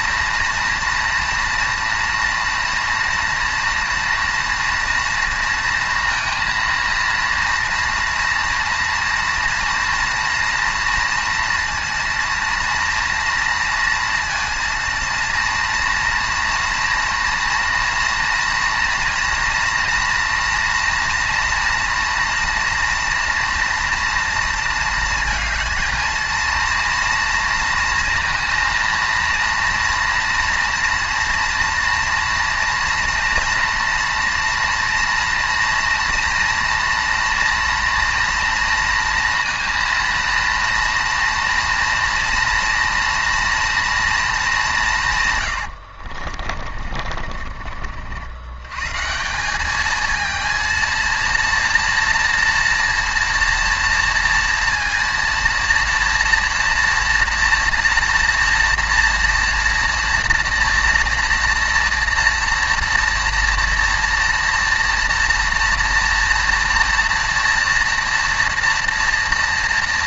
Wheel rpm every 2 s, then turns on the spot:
230, 230, 230, 230, 230, 230, 230, 230, 230, 230, 230, 230, 230, 230, 230, 230, 230, 230, 230, 230, 230, 230, 210, 40, 110, 230, 240, 230, 230, 230, 230, 230, 230, 230, 230.
46-48